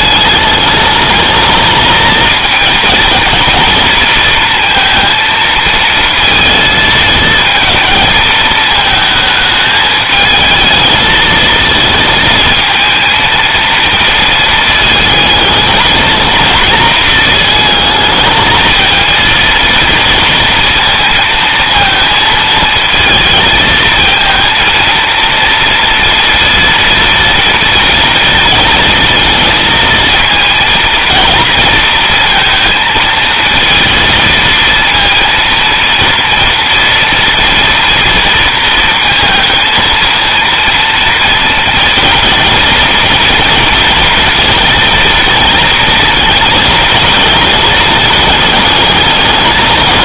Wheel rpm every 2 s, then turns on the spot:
220, 230, 230, 220, 220, 220, 230, 220, 220, 230, 230, 220, 230, 230, 230, 230, 230, 230, 230, 230, 230, 230, 230, 220, 210.
none